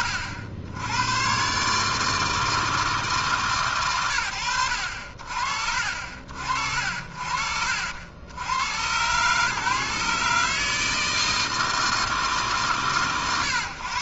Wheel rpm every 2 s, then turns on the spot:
60, 160, 80, 60, 90, 160, 120.
none